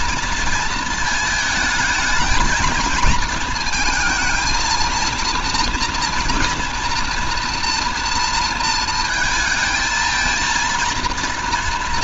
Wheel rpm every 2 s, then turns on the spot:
230, 220, 230, 230, 230, 230.
none